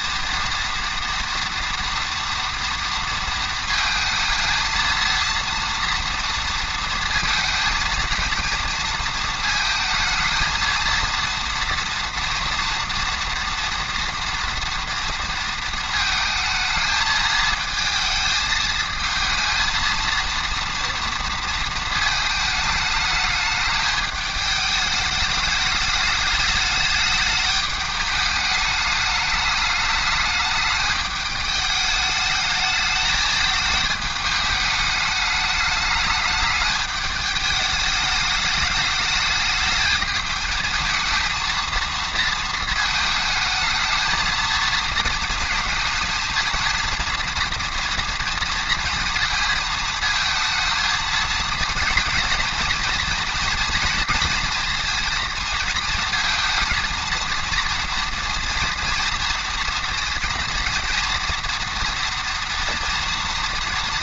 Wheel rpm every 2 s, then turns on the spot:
230, 230, 230, 230, 230, 220, 240, 230, 220, 220, 230, 220, 220, 210, 210, 210, 220, 210, 210, 210, 220, 220, 220, 230, 230, 220, 220, 230, 230, 230, 230, 230.
none